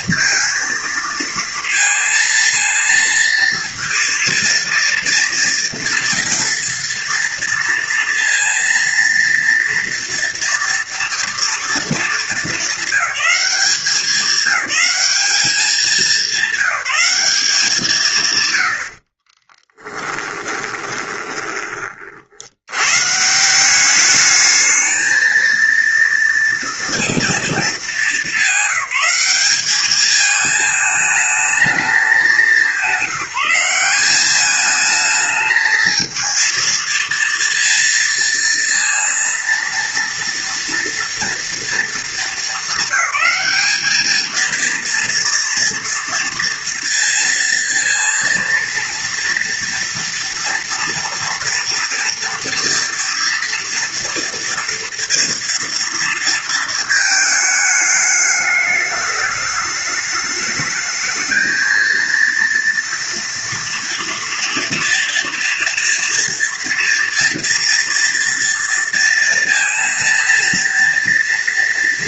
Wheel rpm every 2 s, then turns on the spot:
230, 230, 230, 230, 230, 230, 220, 200, 200, 90, 20, 120, 220, 230, 200, 220, 190, 220, 230, 230, 240, 220, 230, 230, 230, 230, 230, 230, 230, 210, 210, 230, 230, 230, 230, 230.
20-22